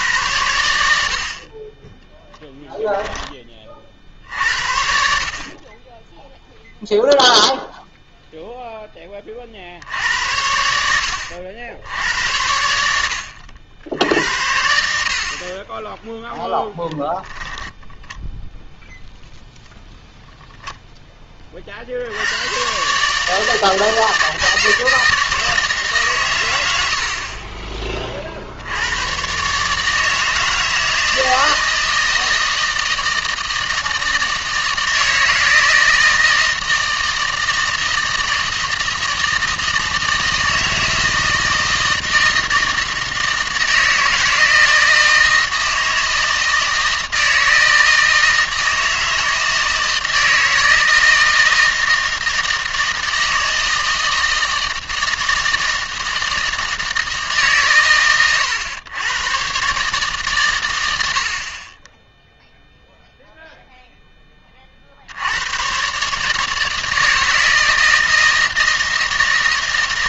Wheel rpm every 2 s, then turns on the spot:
80, 10, 70, 0, 0, 80, 80, 70, 10, 0, 0, 130, 160, 90, 80, 160, 160, 160, 160, 160, 160, 160, 160, 160, 160, 160, 160, 160, 160, 120, 110, 0, 40, 160, 160.
2-4 16-18